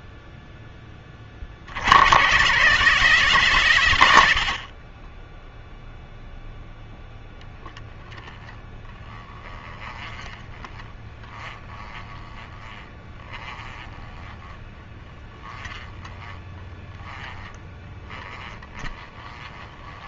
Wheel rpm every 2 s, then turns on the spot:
10, 140, 60, 0, 10, 20, 20, 20, 20, 20.
8-20